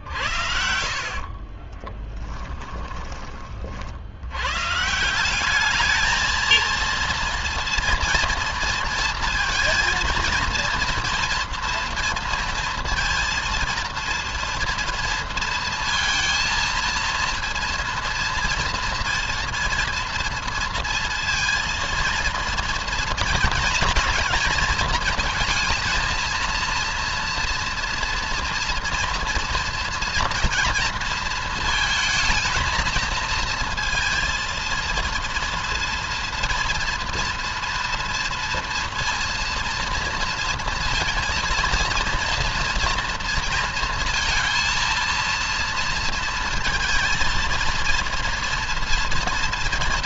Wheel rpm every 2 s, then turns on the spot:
50, 20, 150, 230, 230, 230, 230, 230, 230, 230, 230, 230, 230, 230, 230, 230, 220, 230, 240, 230, 230, 230, 230, 230, 230.
0-2